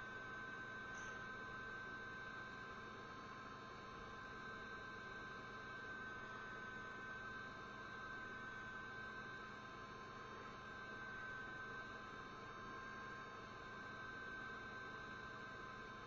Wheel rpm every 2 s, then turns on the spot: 0, 0, 0, 0, 0, 0, 0, 0.
none